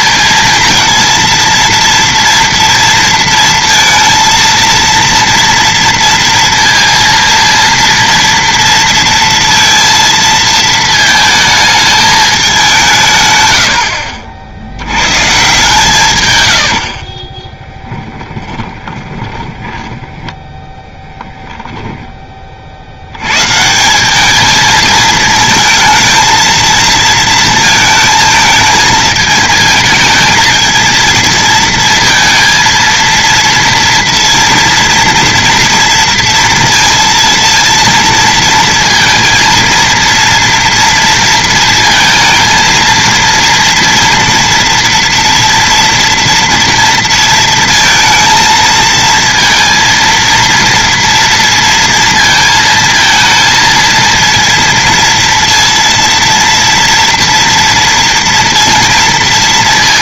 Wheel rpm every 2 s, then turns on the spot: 230, 230, 230, 230, 230, 220, 160, 90, 70, 20, 10, 70, 220, 230, 220, 230, 230, 230, 230, 230, 230, 230, 230, 230, 230, 230, 230, 230, 230, 230.
16-20